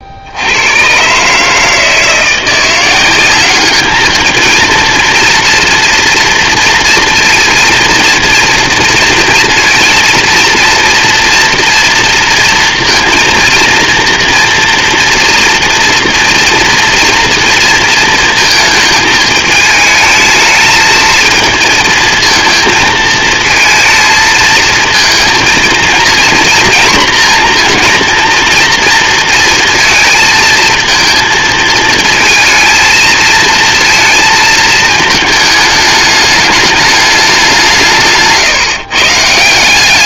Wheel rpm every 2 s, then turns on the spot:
80, 170, 230, 230, 240, 230, 230, 230, 240, 220, 220, 230, 220, 240, 230, 230, 230, 220, 210, 150.
none